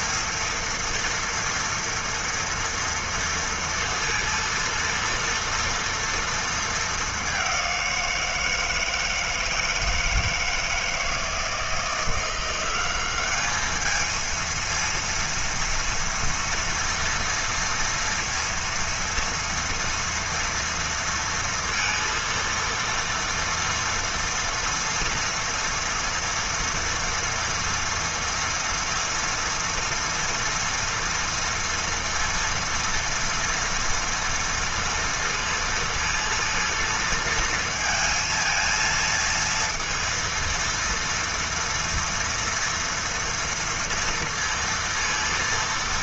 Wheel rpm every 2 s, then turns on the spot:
240, 230, 230, 220, 160, 160, 190, 230, 230, 230, 230, 230, 230, 230, 230, 230, 230, 230, 230, 230, 230, 230, 230.
none